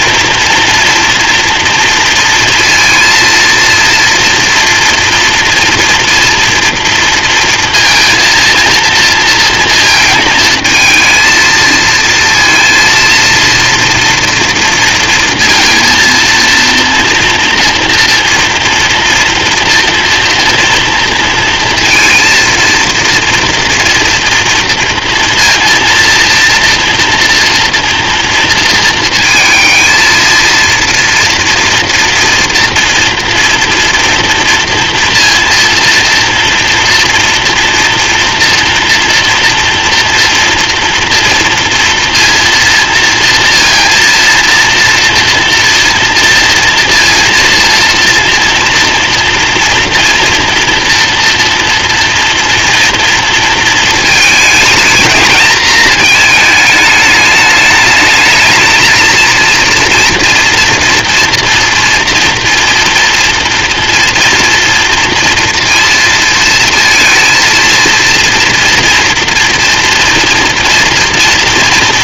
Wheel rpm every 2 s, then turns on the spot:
230, 230, 230, 240, 230, 220, 230, 230, 230, 230, 240, 230, 230, 230, 230, 230, 230, 230, 230, 230, 230, 230, 230, 230, 230, 230, 240, 220, 220, 220, 230, 230, 230, 230, 230, 240.
none